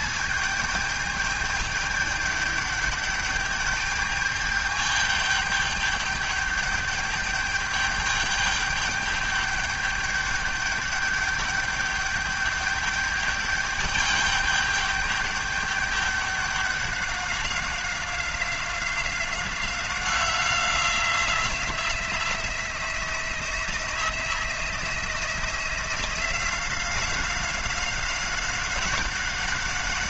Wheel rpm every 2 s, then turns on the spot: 220, 210, 210, 210, 210, 210, 210, 200, 200, 180, 180, 170, 170, 180, 190.
none